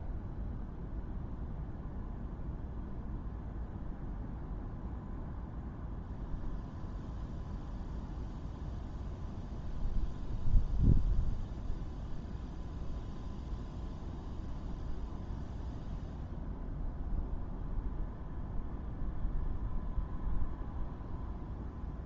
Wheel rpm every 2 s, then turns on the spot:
0, 0, 0, 0, 0, 0, 0, 0, 0, 0, 0.
none